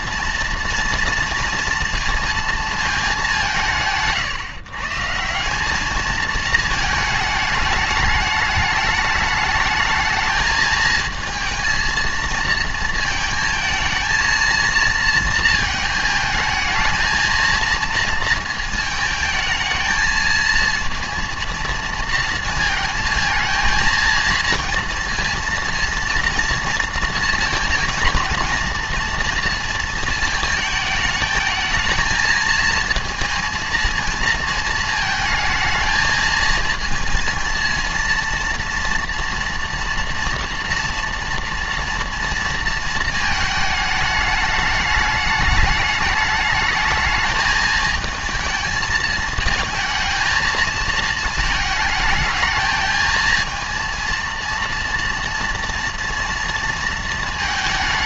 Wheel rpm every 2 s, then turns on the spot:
230, 200, 170, 210, 210, 220, 220, 230, 230, 220, 230, 230, 230, 230, 230, 210, 230, 220, 230, 230, 230, 220, 210, 220, 220, 220, 220, 230, 220.
none